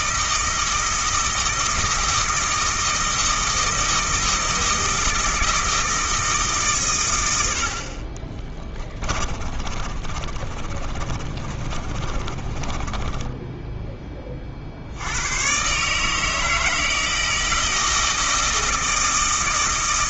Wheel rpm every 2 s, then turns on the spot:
160, 160, 160, 130, 20, 30, 20, 70, 160, 160.
8-14